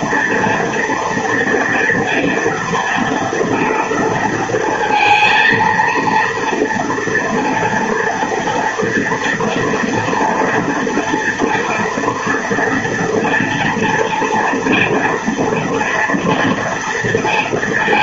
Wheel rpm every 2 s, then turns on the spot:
230, 230, 230, 230, 230, 230, 230, 240, 230.
none